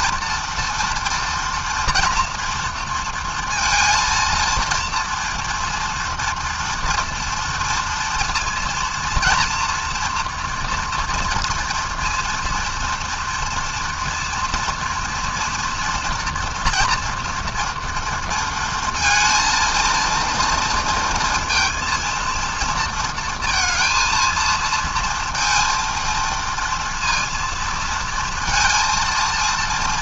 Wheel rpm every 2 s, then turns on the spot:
230, 230, 230, 230, 230, 230, 240, 230, 240, 230, 230, 230, 230, 230, 230.
none